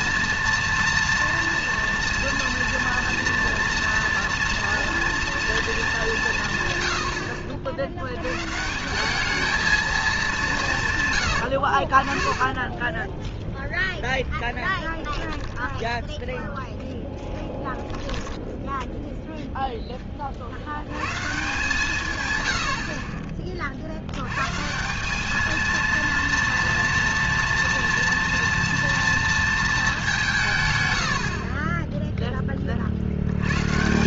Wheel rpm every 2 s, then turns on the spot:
240, 230, 230, 120, 150, 170, 20, 10, 0, 0, 60, 80, 140, 230, 230, 150, 40.
12-14